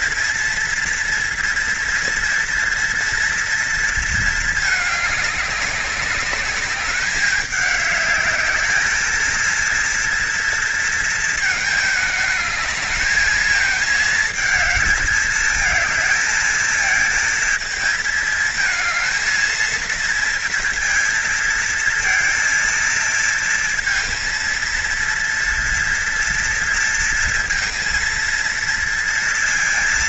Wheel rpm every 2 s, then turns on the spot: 230, 240, 220, 200, 210, 230, 210, 220, 230, 220, 230, 230, 230, 230, 230.
none